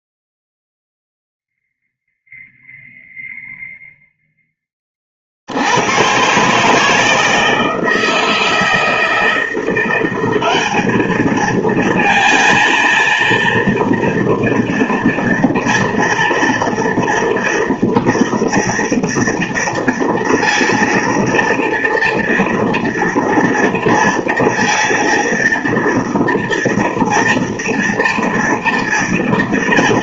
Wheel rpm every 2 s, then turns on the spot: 0, 0, 0, 120, 160, 190, 220, 240, 230, 230, 230, 230, 230, 230, 230.
none